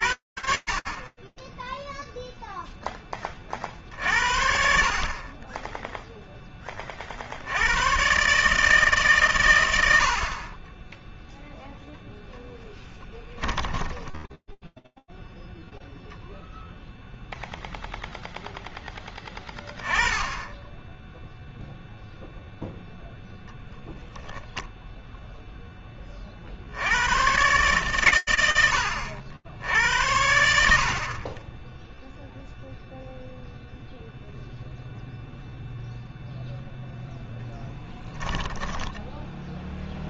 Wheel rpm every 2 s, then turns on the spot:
60, 0, 50, 30, 150, 20, 10, 0, 0, 10, 10, 0, 0, 150, 80, 10, 0, 0, 10, 0.
12-14 36-38